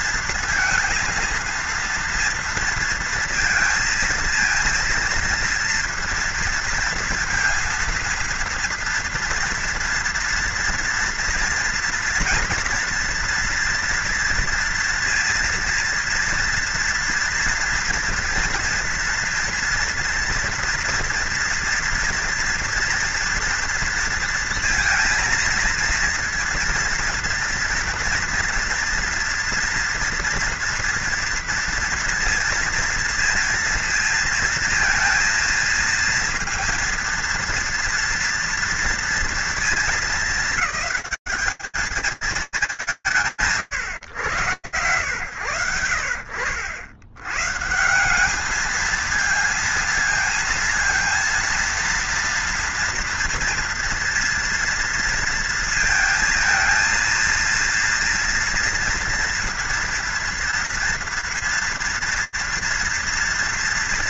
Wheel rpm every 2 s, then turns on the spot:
230, 230, 230, 230, 240, 230, 240, 230, 230, 230, 230, 230, 230, 230, 230, 230, 230, 230, 230, 230, 220, 170, 110, 70, 220, 230, 230, 230, 230, 230, 230, 230.
none